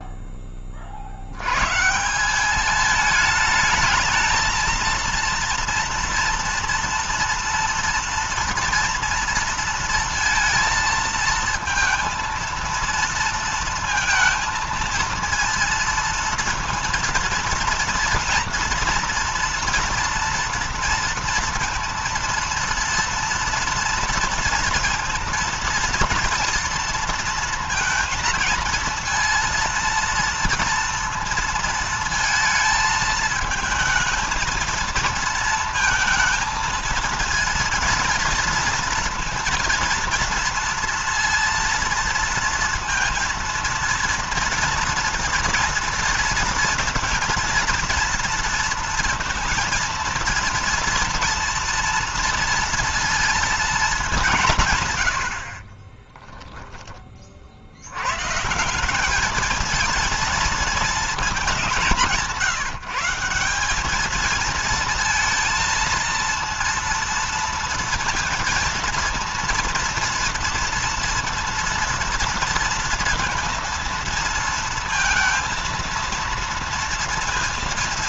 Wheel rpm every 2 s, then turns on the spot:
20, 200, 220, 230, 230, 230, 230, 230, 230, 230, 230, 230, 230, 230, 230, 230, 220, 220, 230, 230, 230, 230, 230, 230, 230, 230, 230, 160, 20, 160, 230, 170, 220, 230, 230, 230, 230, 230, 230.
none